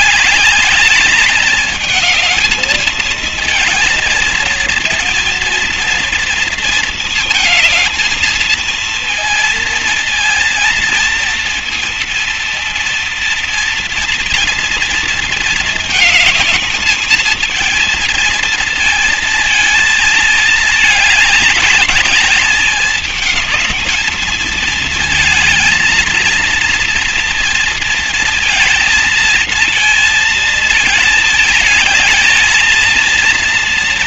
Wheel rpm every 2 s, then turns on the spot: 210, 210, 230, 230, 220, 230, 230, 230, 220, 230, 220, 200, 220, 230, 230, 230, 230.
none